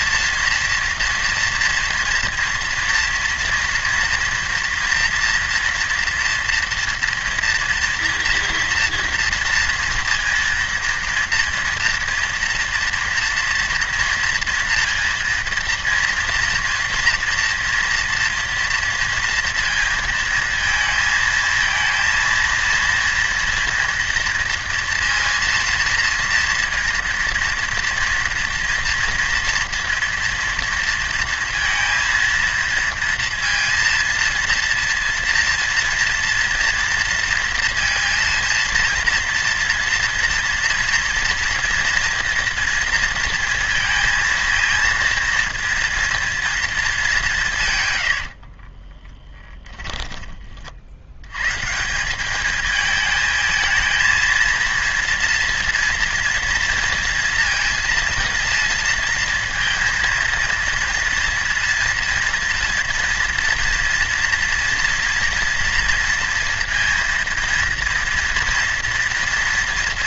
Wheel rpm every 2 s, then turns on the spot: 230, 230, 230, 240, 230, 230, 230, 230, 230, 230, 220, 220, 230, 230, 230, 230, 230, 230, 230, 230, 230, 230, 230, 230, 50, 40, 210, 230, 230, 230, 230, 230, 230, 230, 230.
48-50